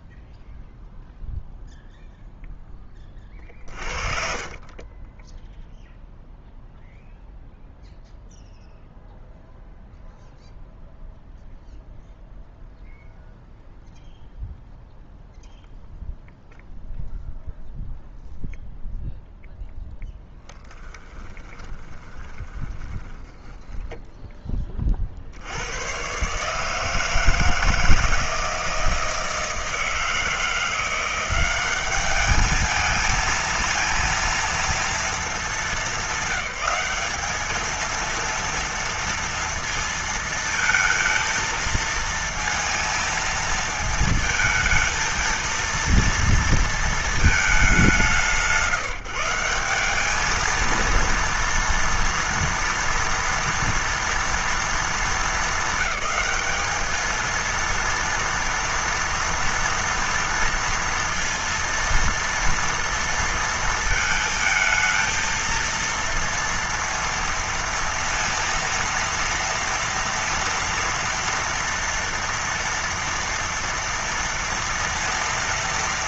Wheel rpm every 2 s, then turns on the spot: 0, 10, 30, 0, 0, 0, 0, 0, 0, 0, 10, 20, 40, 150, 160, 170, 220, 230, 200, 230, 230, 230, 220, 230, 160, 230, 240, 220, 210, 230, 230, 230, 220, 230, 230, 230, 230, 230.
4-6 20-24